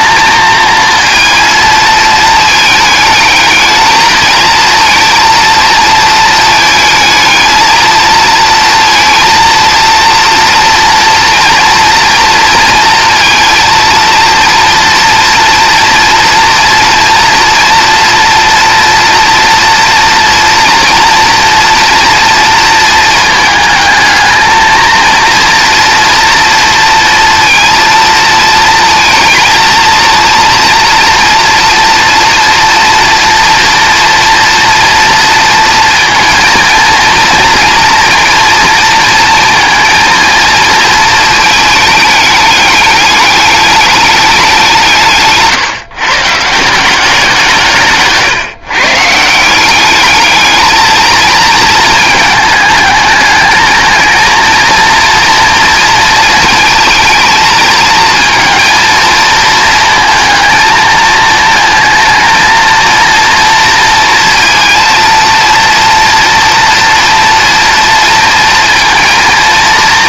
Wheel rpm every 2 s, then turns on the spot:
230, 220, 230, 220, 230, 230, 230, 230, 240, 230, 230, 230, 220, 230, 230, 240, 230, 230, 230, 230, 230, 210, 180, 170, 140, 220, 210, 230, 220, 230, 230, 230, 230, 230, 230.
none